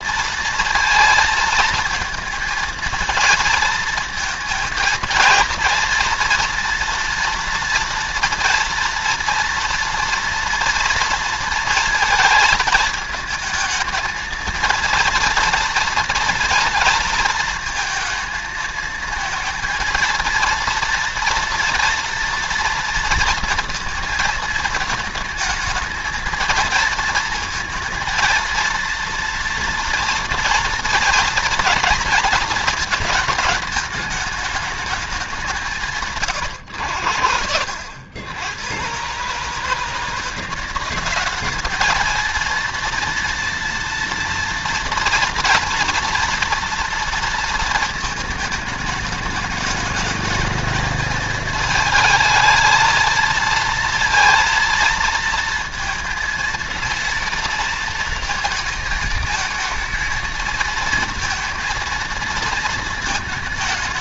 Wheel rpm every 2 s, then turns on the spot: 230, 230, 230, 230, 240, 230, 220, 230, 230, 230, 230, 230, 220, 230, 230, 230, 220, 200, 90, 110, 190, 230, 230, 230, 210, 220, 220, 230, 230, 220, 230, 220.
none